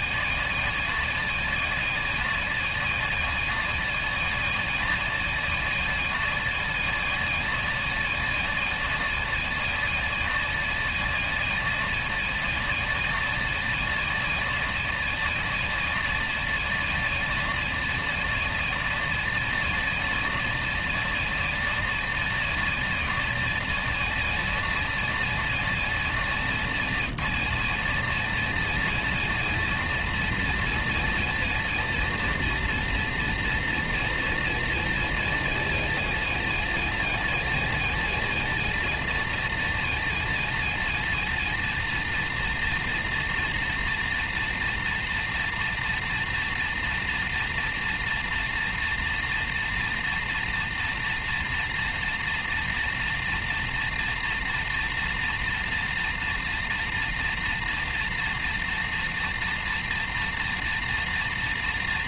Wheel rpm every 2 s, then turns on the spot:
130, 140, 130, 130, 130, 130, 130, 130, 140, 130, 130, 140, 130, 120, 130, 130, 120, 120, 120, 120, 120, 120, 120, 120, 120, 120, 120, 120, 120, 120, 120.
none